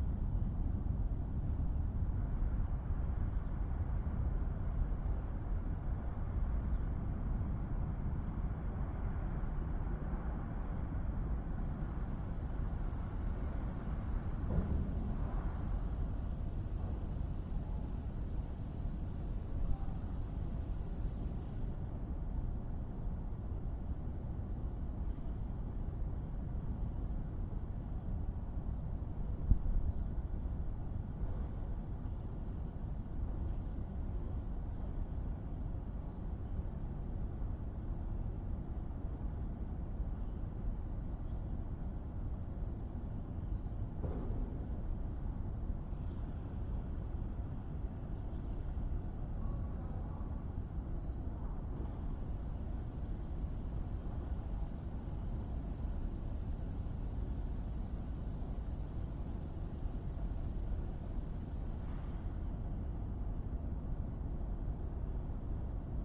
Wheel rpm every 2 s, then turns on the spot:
0, 0, 0, 0, 0, 0, 0, 0, 0, 0, 0, 0, 0, 0, 0, 0, 0, 0, 0, 0, 0, 0, 0, 0, 0, 0, 0, 0, 0, 0, 0, 0, 0.
none